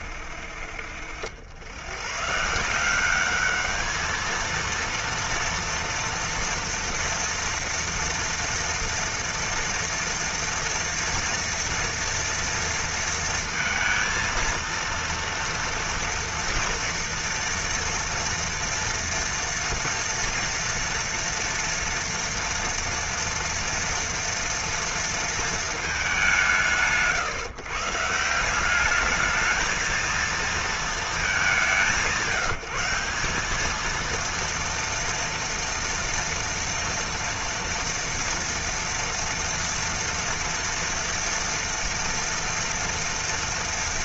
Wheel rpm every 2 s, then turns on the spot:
60, 180, 230, 230, 230, 230, 230, 230, 240, 230, 230, 240, 240, 140, 200, 220, 180, 230, 230, 230, 230, 230.
none